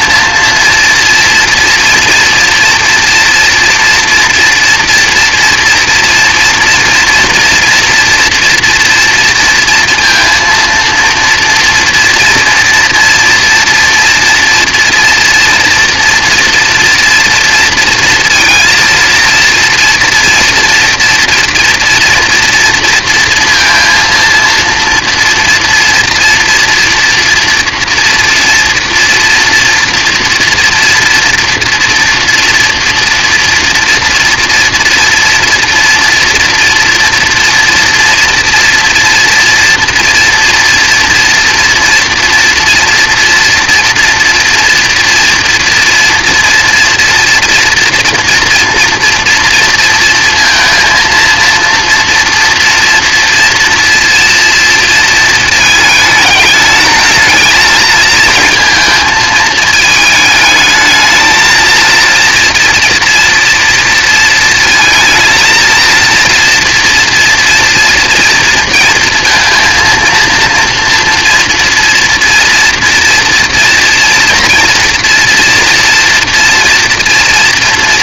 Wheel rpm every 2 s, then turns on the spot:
230, 240, 240, 230, 230, 230, 230, 230, 230, 230, 240, 240, 230, 230, 240, 230, 230, 230, 240, 240, 230, 230, 230, 230, 230, 230, 230, 230, 220, 220, 220, 240, 230, 230, 230, 240, 240, 230, 230.
none